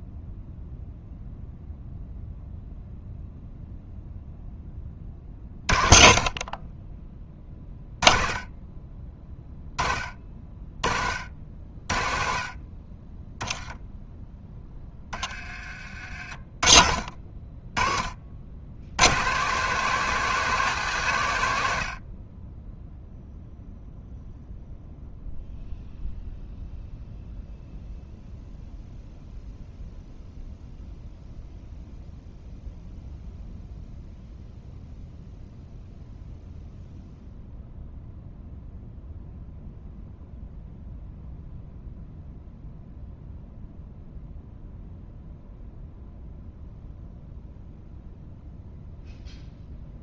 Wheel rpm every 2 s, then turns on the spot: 0, 0, 0, 40, 20, 30, 40, 10, 40, 60, 180, 30, 0, 0, 0, 0, 0, 0, 0, 0, 0, 0, 0, 0, 0.
none